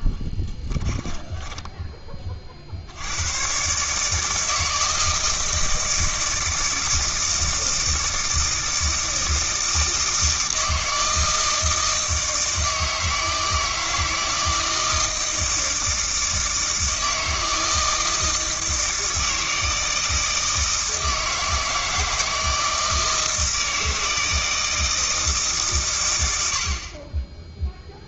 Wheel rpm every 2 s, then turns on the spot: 10, 70, 160, 160, 160, 160, 160, 160, 160, 160, 160, 160, 160, 60.
0-2